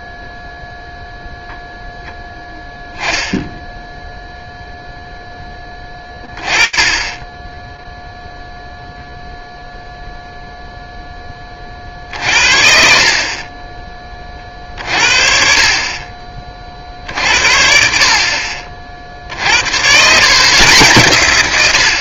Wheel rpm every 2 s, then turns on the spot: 0, 0, 10, 0, 0, 10, 50, 40, 60, 60, 100.
none